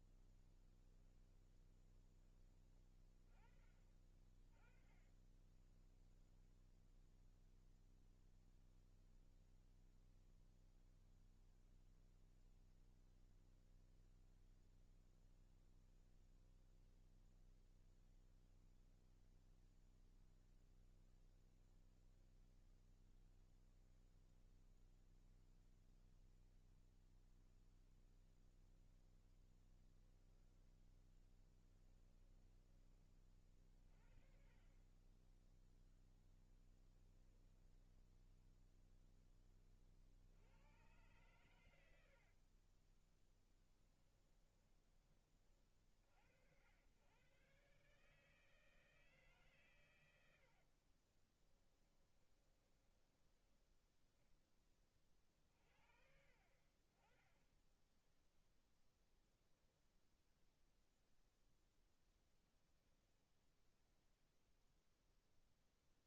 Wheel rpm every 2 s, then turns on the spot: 20, 30, 30, 0, 0, 0, 0, 0, 0, 0, 0, 0, 0, 0, 0, 10, 30, 20, 10, 10, 110, 10, 30, 110, 150, 30, 10, 30, 20, 0, 0, 0, 0.
0-2 4-6 36-38 42-44 50-52